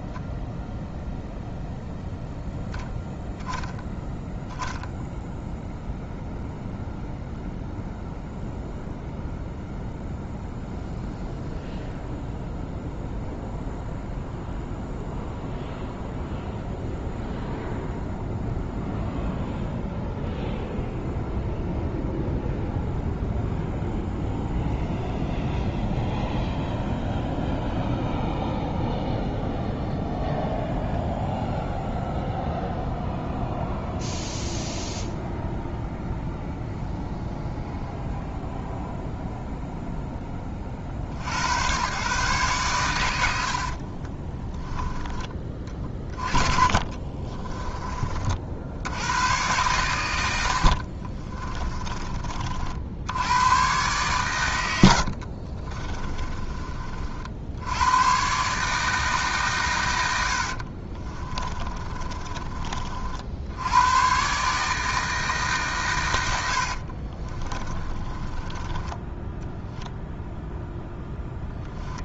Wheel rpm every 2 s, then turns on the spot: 0, 0, 0, 0, 0, 0, 0, 0, 0, 0, 0, 0, 0, 0, 0, 0, 0, 0, 0, 0, 60, 120, 10, 30, 80, 60, 60, 80, 30, 150, 60, 30, 150, 60, 10, 0.
44-48 50-52 54-56 60-62 66-70